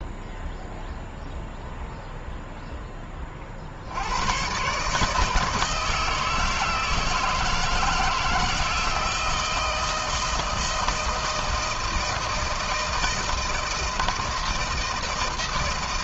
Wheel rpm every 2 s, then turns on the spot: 0, 0, 100, 160, 160, 160, 160, 160.
none